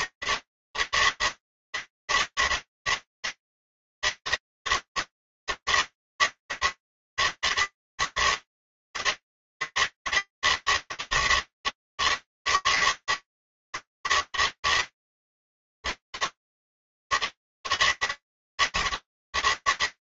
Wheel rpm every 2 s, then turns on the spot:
150, 150, 160, 160, 140, 150, 160, 160, 140, 150.
none